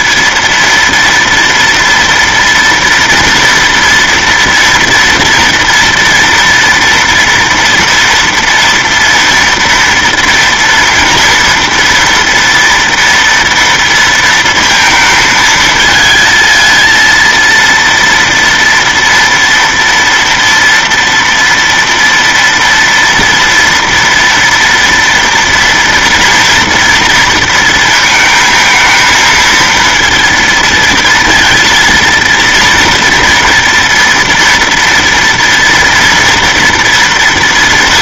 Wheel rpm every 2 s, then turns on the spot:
230, 230, 230, 230, 240, 230, 230, 230, 230, 230, 230, 230, 230, 240, 220, 230, 230, 230, 240.
none